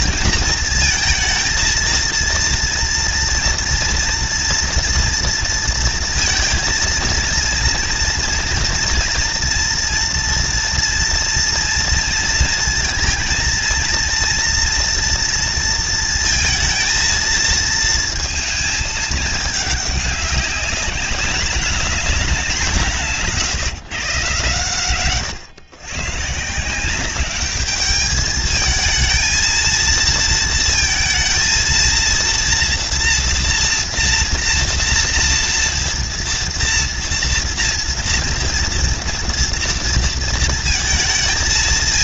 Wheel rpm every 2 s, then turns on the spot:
230, 230, 230, 230, 230, 230, 230, 230, 230, 220, 200, 200, 130, 140, 210, 230, 230, 230, 230, 230, 230.
none